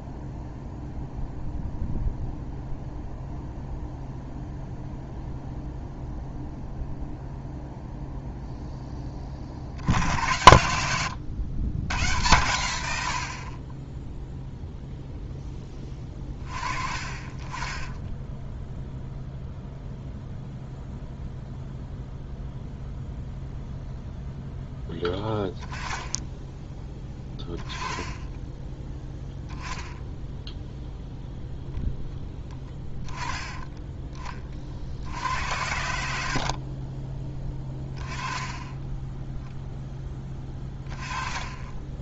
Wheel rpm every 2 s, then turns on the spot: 0, 0, 0, 0, 0, 80, 110, 0, 30, 0, 0, 0, 0, 10, 10, 0, 10, 40, 50, 10, 20.
36-38